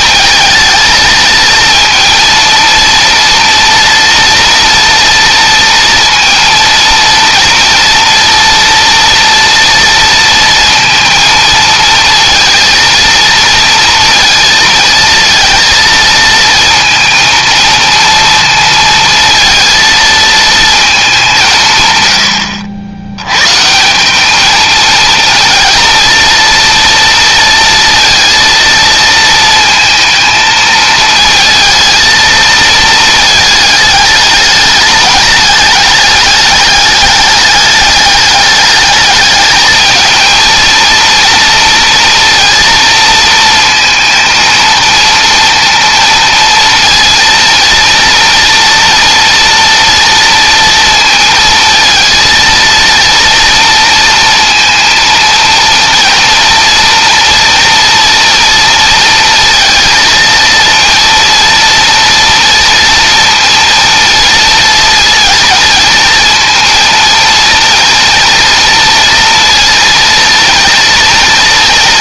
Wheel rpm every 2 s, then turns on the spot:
220, 230, 230, 230, 230, 230, 220, 220, 230, 230, 230, 90, 220, 230, 230, 220, 230, 210, 210, 210, 220, 230, 230, 230, 230, 230, 230, 230, 230, 230, 230, 230, 230, 230, 230, 230.
none